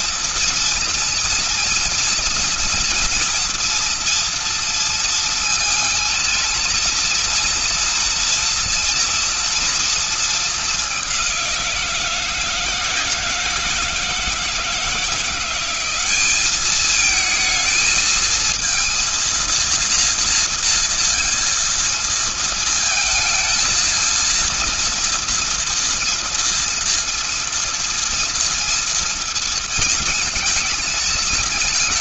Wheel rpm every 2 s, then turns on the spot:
230, 230, 230, 230, 230, 200, 160, 170, 220, 230, 230, 220, 230, 230, 230, 230.
none